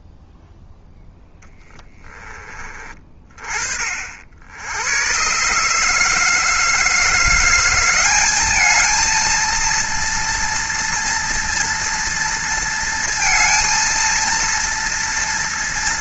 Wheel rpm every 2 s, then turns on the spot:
0, 20, 70, 160, 210, 230, 230, 230.
none